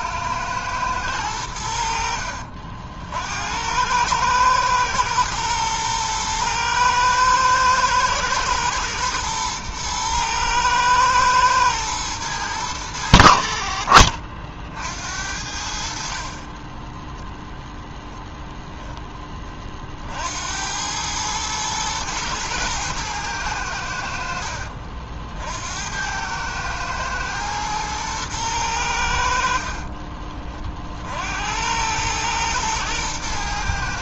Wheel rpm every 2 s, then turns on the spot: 110, 60, 110, 110, 110, 110, 110, 50, 30, 0, 80, 110, 60, 110, 100, 30, 110.
16-18